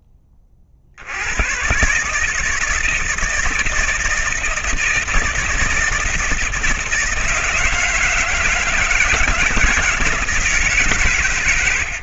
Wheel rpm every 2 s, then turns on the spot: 50, 160, 160, 160, 170, 160.
none